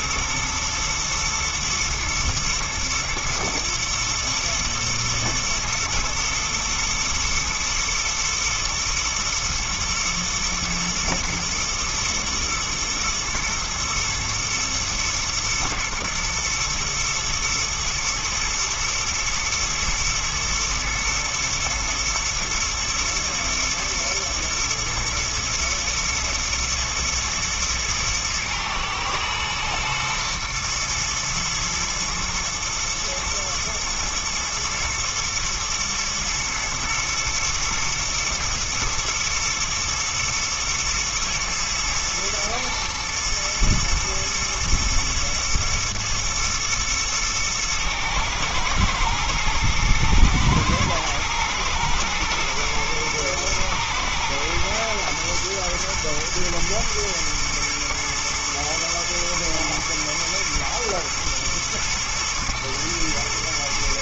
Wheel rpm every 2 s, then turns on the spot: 110, 110, 110, 110, 120, 110, 120, 110, 110, 110, 120, 110, 120, 110, 110, 110, 110, 110, 120, 120, 120, 120, 110, 110, 110, 120, 120, 120, 110, 110, 110, 120.
none